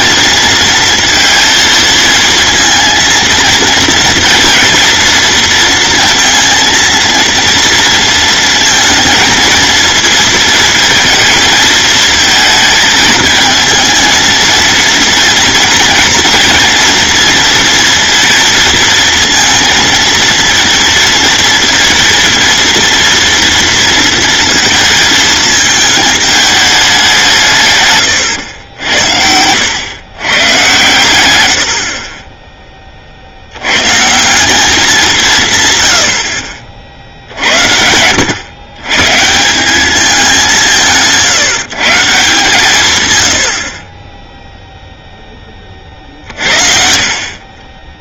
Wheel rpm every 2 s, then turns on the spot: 230, 230, 230, 230, 230, 230, 220, 230, 230, 230, 230, 230, 220, 190, 70, 120, 30, 190, 50, 130, 160, 140, 0, 50.
none